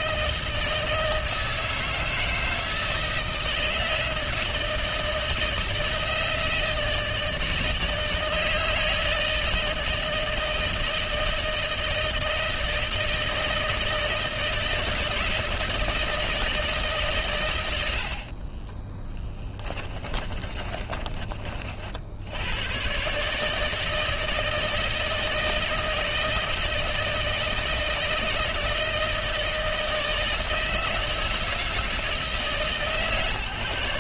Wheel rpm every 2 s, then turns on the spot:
160, 160, 160, 160, 160, 160, 160, 160, 150, 30, 30, 110, 160, 160, 160, 160, 150.
18-22